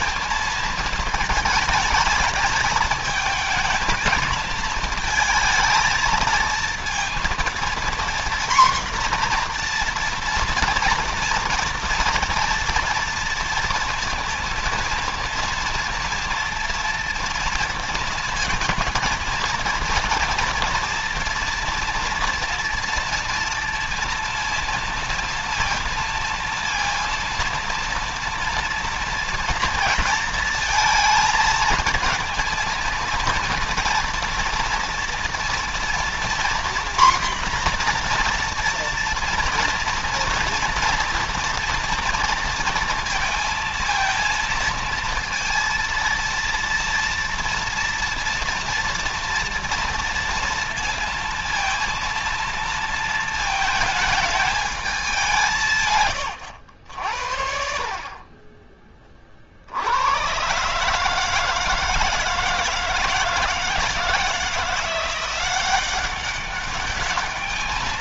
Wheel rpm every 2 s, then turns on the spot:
220, 220, 220, 230, 240, 230, 240, 230, 240, 230, 230, 230, 230, 230, 230, 230, 230, 230, 240, 240, 230, 230, 230, 230, 230, 230, 230, 210, 90, 30, 130, 160, 170, 200.
none